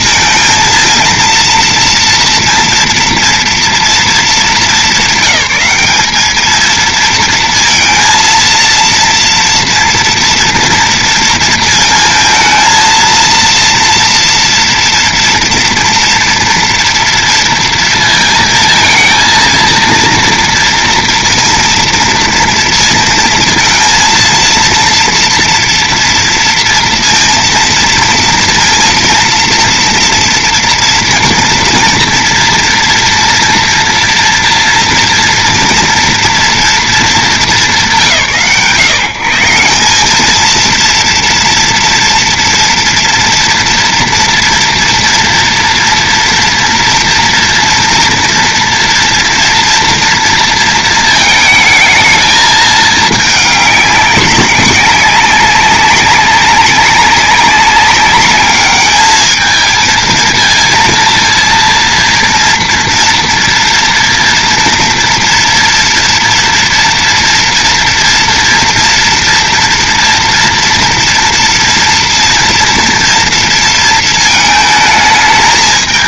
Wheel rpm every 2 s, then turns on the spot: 220, 230, 210, 220, 230, 230, 220, 230, 230, 220, 230, 230, 230, 230, 230, 230, 230, 230, 230, 130, 220, 230, 230, 230, 230, 230, 220, 190, 200, 210, 230, 230, 230, 230, 230, 230, 230, 220.
none